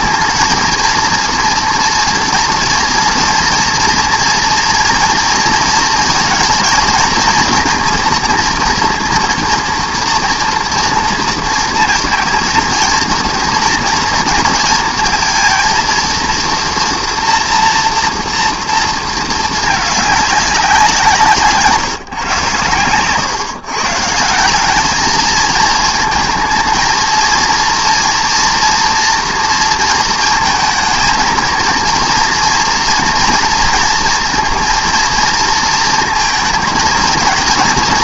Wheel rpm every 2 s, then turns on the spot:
230, 240, 230, 230, 230, 230, 230, 230, 240, 230, 180, 120, 200, 230, 230, 220, 240, 240, 230.
none